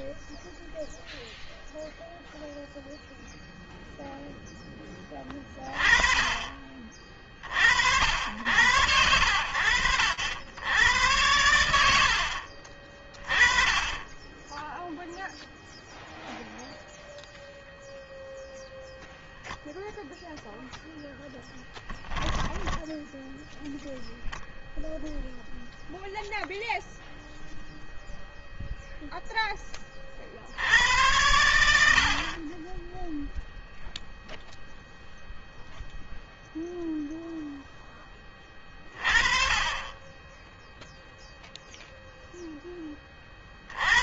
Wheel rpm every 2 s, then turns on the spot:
0, 0, 30, 50, 90, 80, 20, 0, 0, 0, 10, 0, 0, 0, 20, 70, 0, 0, 10, 20, 0, 30.
none